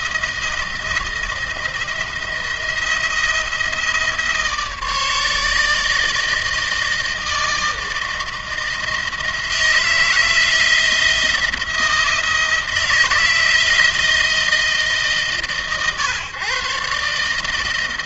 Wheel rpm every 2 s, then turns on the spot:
160, 170, 150, 160, 160, 170, 160, 150, 140.
none